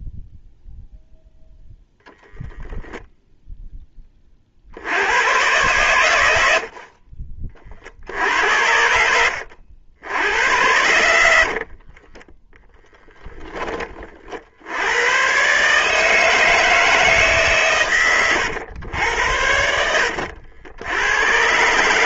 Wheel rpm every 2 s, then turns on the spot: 0, 0, 90, 40, 70, 100, 10, 100, 150, 80, 90.
10-12